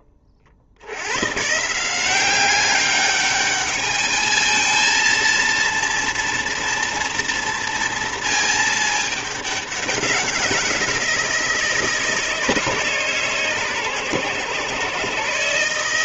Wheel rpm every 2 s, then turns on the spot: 70, 200, 220, 240, 220, 180, 160, 130.
none